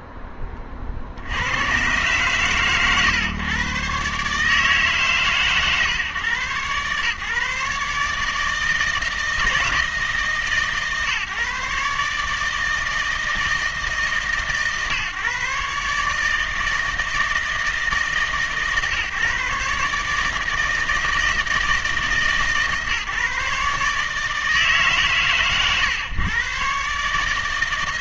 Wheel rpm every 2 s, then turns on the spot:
30, 120, 150, 130, 160, 140, 160, 140, 160, 140, 160, 140, 150, 140.
none